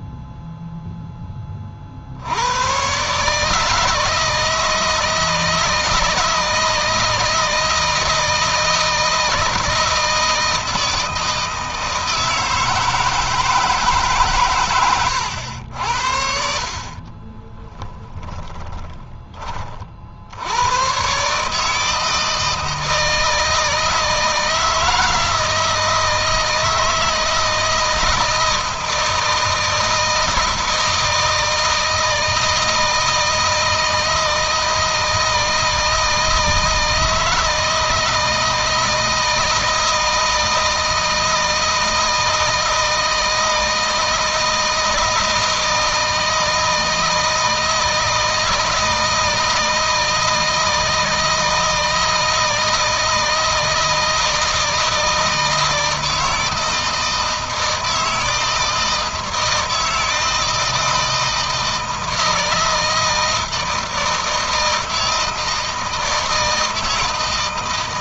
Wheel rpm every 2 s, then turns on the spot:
0, 110, 160, 160, 160, 160, 160, 130, 50, 30, 120, 160, 160, 160, 160, 160, 160, 160, 160, 160, 160, 160, 160, 160, 160, 160, 160, 160, 160, 160, 160, 160, 160, 160.
14-20